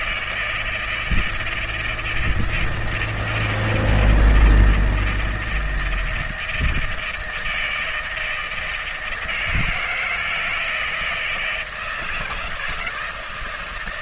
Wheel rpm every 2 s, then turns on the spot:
160, 160, 160, 160, 160, 160, 170.
none